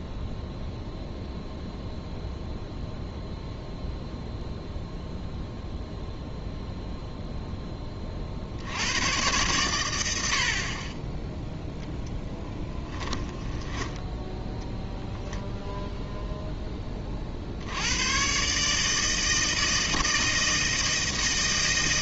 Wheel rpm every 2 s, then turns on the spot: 0, 0, 0, 10, 90, 0, 10, 0, 60, 160, 160.
12-14